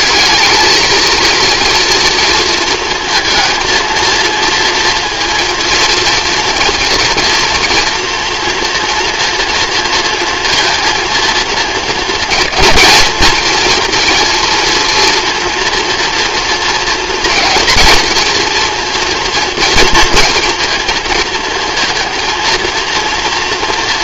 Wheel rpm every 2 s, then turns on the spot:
220, 230, 230, 230, 240, 230, 230, 230, 230, 230, 220, 230.
none